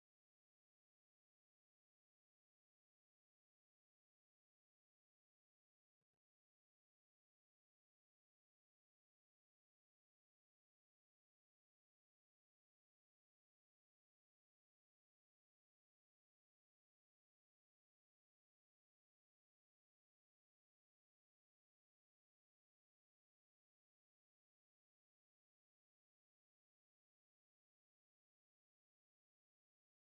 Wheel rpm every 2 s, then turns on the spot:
0, 0, 0, 0, 0, 0, 0, 0, 0, 0, 0, 0, 0, 0, 0.
none